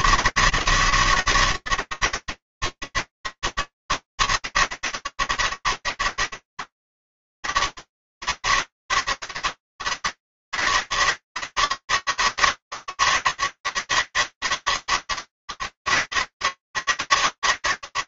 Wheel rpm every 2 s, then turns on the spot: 170, 200, 200, 200, 200, 200, 200, 200, 180.
none